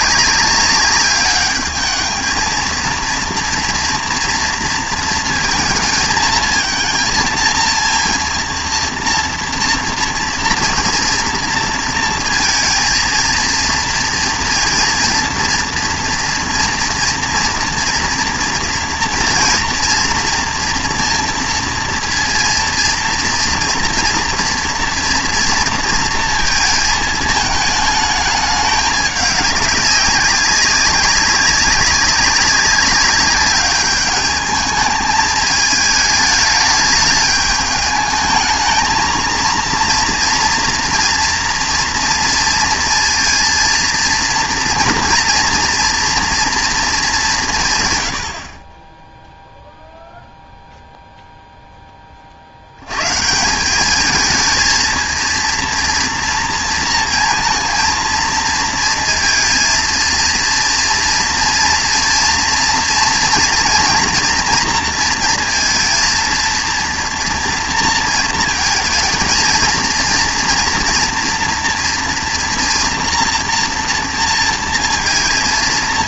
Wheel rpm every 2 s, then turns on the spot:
200, 230, 230, 230, 230, 240, 230, 230, 230, 230, 230, 230, 230, 230, 210, 190, 200, 210, 210, 220, 240, 230, 230, 230, 60, 0, 70, 220, 230, 230, 230, 230, 230, 230, 220, 230, 230, 230.
none